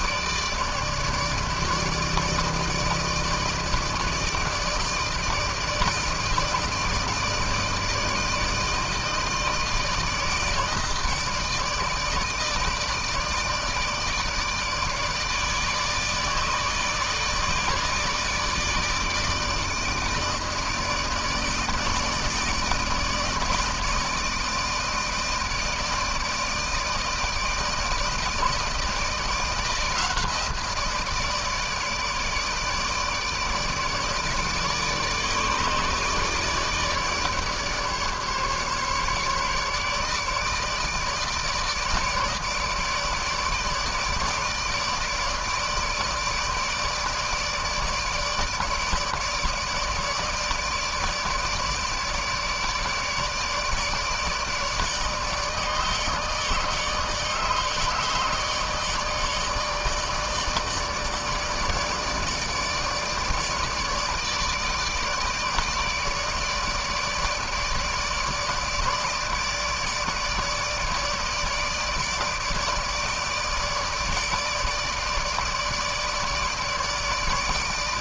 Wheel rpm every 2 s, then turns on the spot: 150, 160, 160, 160, 160, 160, 160, 150, 150, 160, 150, 160, 160, 160, 160, 160, 160, 160, 160, 150, 150, 150, 160, 160, 150, 160, 150, 150, 160, 150, 150, 150, 150, 160, 150, 150, 160, 160, 150.
none